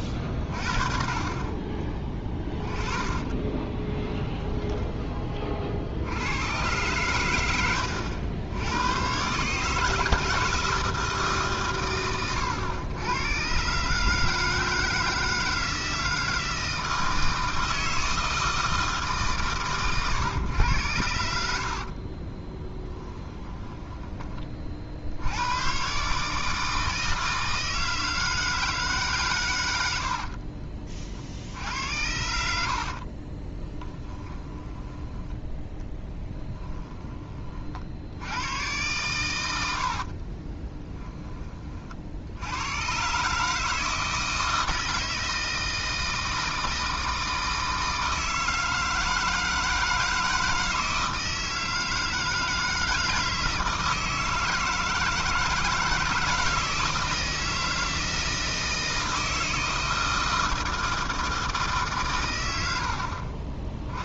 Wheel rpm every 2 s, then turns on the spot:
30, 10, 10, 110, 100, 160, 110, 160, 160, 160, 110, 10, 50, 160, 160, 40, 60, 10, 10, 110, 20, 100, 160, 160, 160, 160, 160, 160, 160, 160, 160, 90.
2-6 22-24 30-38 40-42